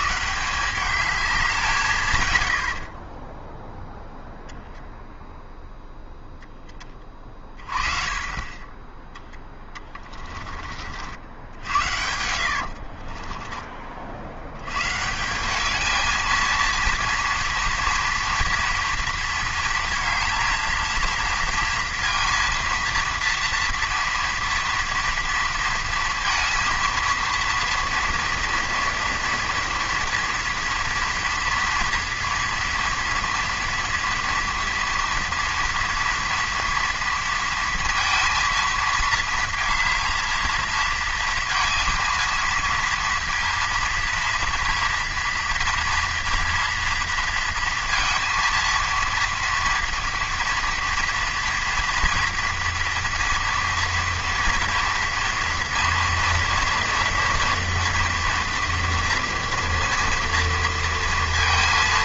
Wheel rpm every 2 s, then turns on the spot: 180, 80, 0, 20, 20, 40, 60, 110, 230, 230, 230, 230, 230, 230, 230, 230, 230, 230, 230, 230, 220, 230, 230, 230, 230, 230, 230, 230, 240, 230, 230.
12-14